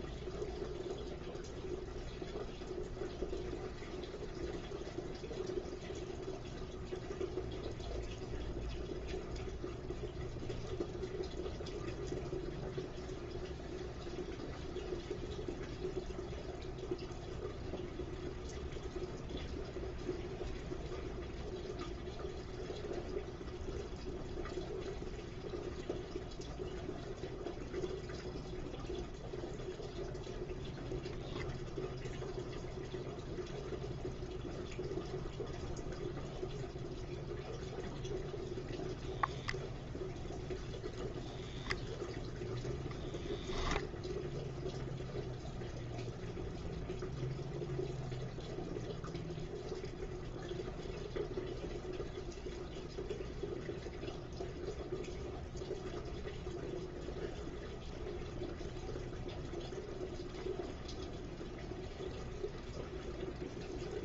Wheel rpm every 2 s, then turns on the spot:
0, 0, 0, 0, 0, 0, 0, 0, 0, 0, 0, 0, 0, 0, 0, 0, 0, 0, 0, 0, 0, 0, 0, 0, 0, 0, 0, 0, 0, 0, 0, 0.
none